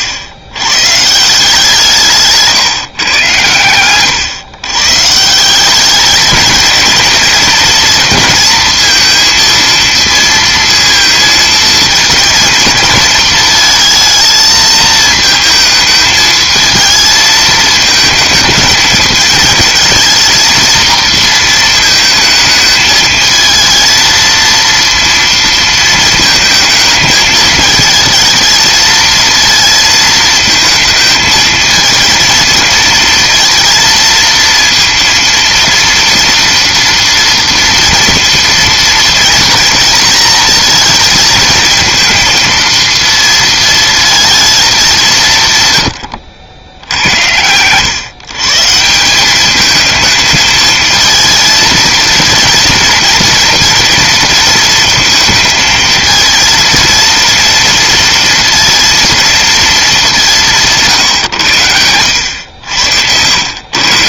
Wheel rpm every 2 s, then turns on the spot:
120, 150, 130, 220, 220, 230, 230, 220, 220, 220, 230, 220, 230, 220, 220, 220, 230, 230, 230, 230, 230, 230, 220, 80, 160, 220, 230, 230, 230, 230, 160, 90.
none